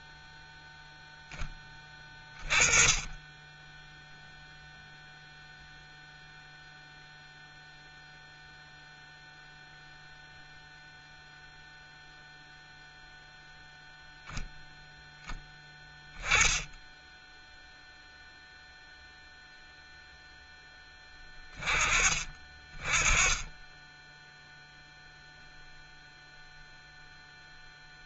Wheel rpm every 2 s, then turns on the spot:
0, 20, 0, 0, 0, 0, 0, 10, 0, 0, 20, 20, 0, 0.
none